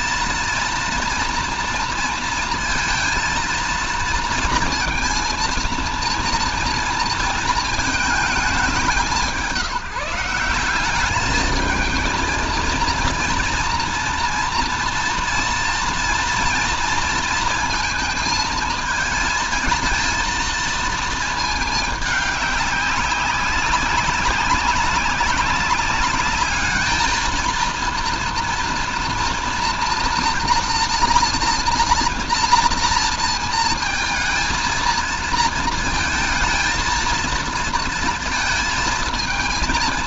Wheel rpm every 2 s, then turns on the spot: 230, 230, 230, 230, 200, 190, 230, 240, 230, 220, 230, 200, 200, 220, 230, 230, 230, 230, 220, 230.
none